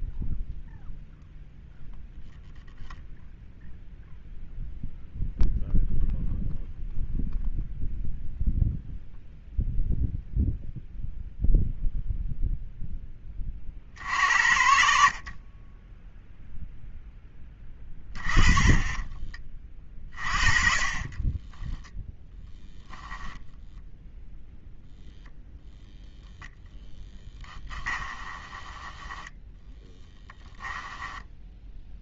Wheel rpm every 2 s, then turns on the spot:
0, 0, 0, 0, 0, 0, 0, 90, 0, 20, 50, 0, 0, 0, 10, 10.
18-22 28-32